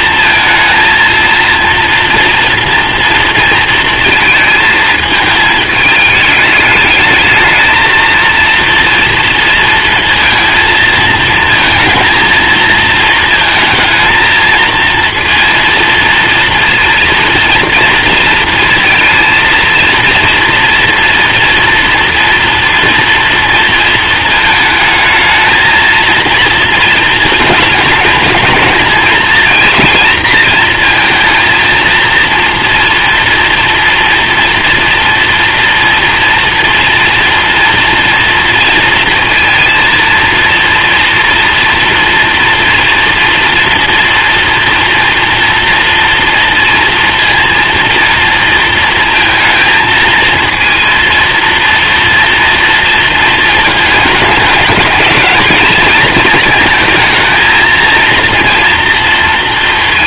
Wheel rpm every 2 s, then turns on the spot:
220, 230, 220, 220, 230, 220, 220, 230, 230, 230, 230, 230, 220, 230, 220, 230, 230, 230, 240, 230, 230, 230, 230, 230, 230, 230, 230, 210, 220, 230.
none